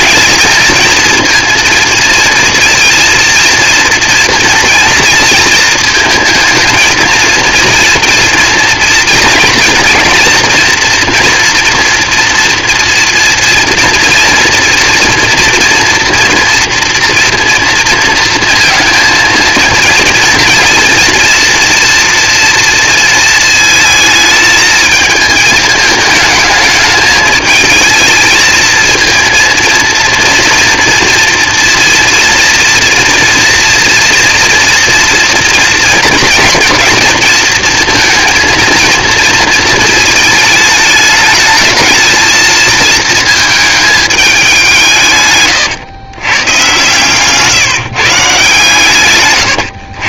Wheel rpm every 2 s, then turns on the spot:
230, 230, 230, 220, 230, 240, 230, 230, 230, 230, 230, 230, 220, 210, 220, 230, 230, 240, 230, 230, 210, 220, 180, 120, 140.
none